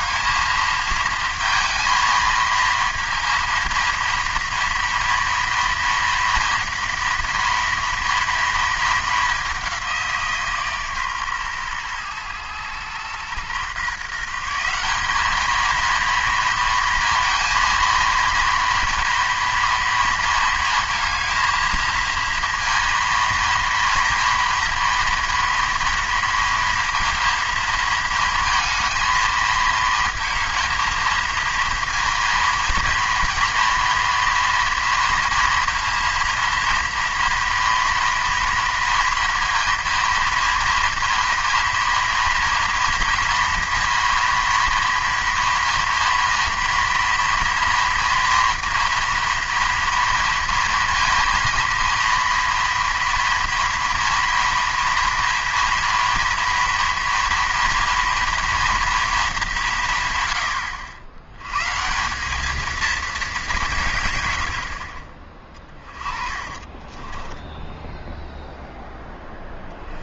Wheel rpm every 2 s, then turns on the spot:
220, 230, 230, 230, 220, 150, 110, 180, 230, 230, 230, 230, 230, 230, 220, 220, 230, 230, 230, 230, 230, 230, 230, 230, 230, 230, 230, 230, 230, 230, 80, 220, 60, 20, 0.
66-68